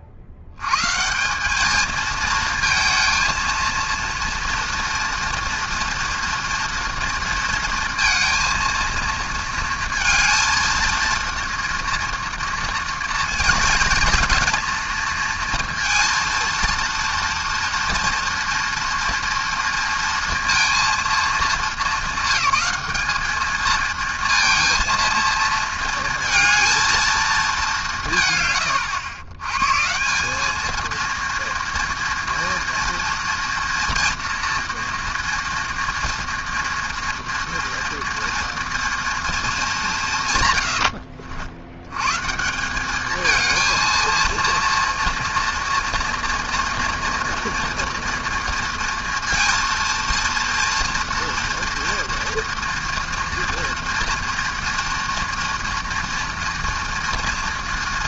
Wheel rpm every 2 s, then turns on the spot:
120, 230, 230, 230, 230, 230, 230, 230, 230, 230, 230, 200, 230, 230, 120, 220, 230, 230, 230, 230, 90, 190, 230, 230, 230, 230, 230, 240, 230.
none